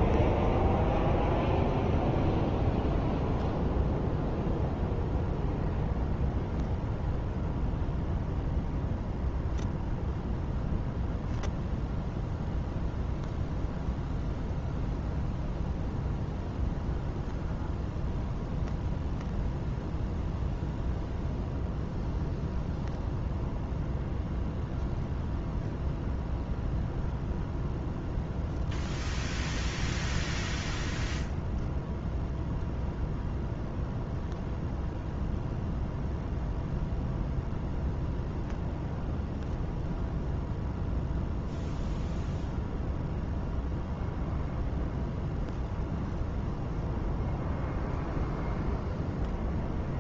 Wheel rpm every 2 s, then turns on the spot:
0, 0, 0, 0, 0, 0, 0, 0, 0, 0, 0, 0, 0, 0, 0, 0, 0, 0, 0, 0, 0, 0, 0, 0, 0.
none